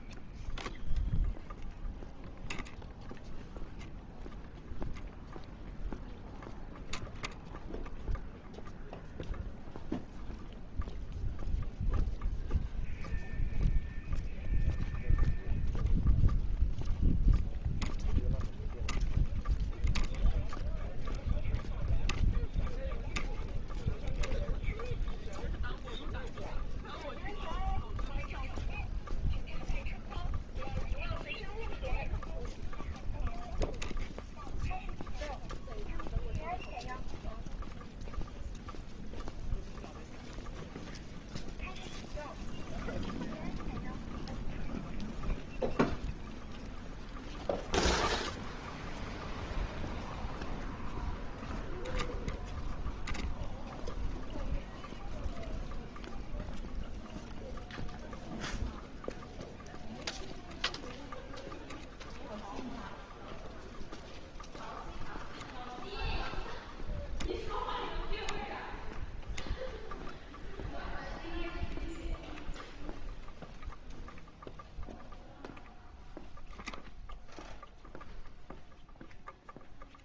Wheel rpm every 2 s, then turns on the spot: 0, 0, 0, 0, 0, 0, 0, 0, 0, 0, 0, 0, 0, 0, 0, 0, 0, 0, 0, 0, 0, 0, 0, 0, 0, 0, 0, 0, 0, 0, 0, 0, 0, 0, 0, 0, 0, 0, 0, 0.
none